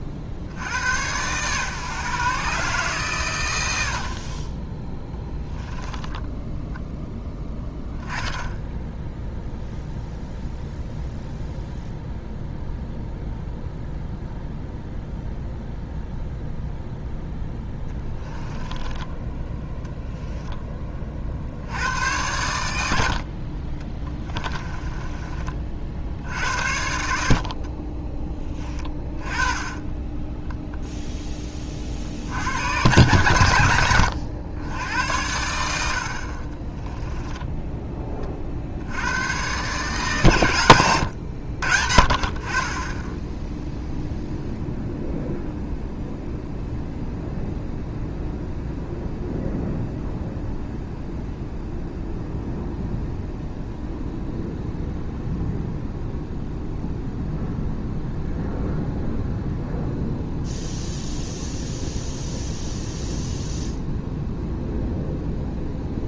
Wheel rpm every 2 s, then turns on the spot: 80, 140, 20, 10, 0, 0, 0, 0, 0, 10, 10, 100, 20, 80, 20, 0, 90, 90, 30, 60, 110, 30, 0, 0, 0, 0, 0, 0, 0, 0, 0, 0, 0.
18-20 24-26 36-38